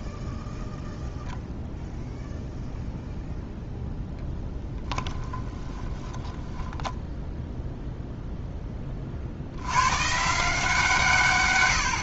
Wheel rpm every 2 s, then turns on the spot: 0, 0, 10, 10, 10, 170.
4-6